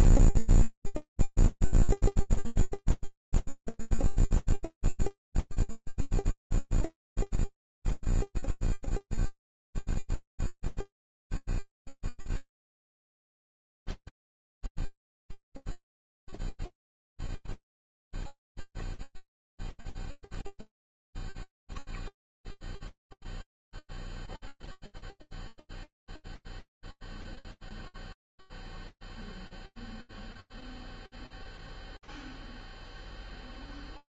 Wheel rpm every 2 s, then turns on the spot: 80, 0, 0, 0, 0, 0, 0, 0, 0, 0, 0, 0, 0, 0, 0, 0, 0.
none